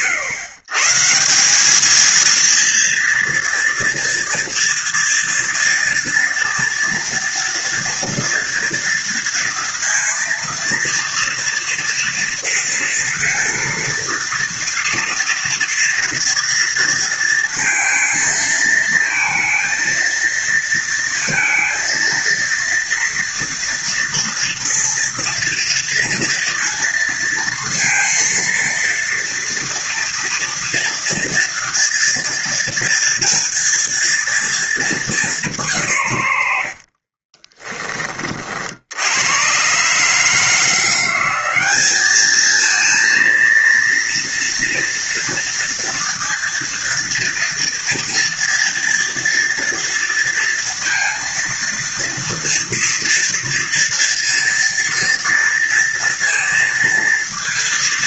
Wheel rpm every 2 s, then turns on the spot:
140, 230, 230, 230, 230, 230, 230, 230, 230, 230, 230, 230, 230, 230, 230, 230, 230, 220, 70, 70, 170, 220, 230, 230, 230, 230, 230, 230, 230.
36-38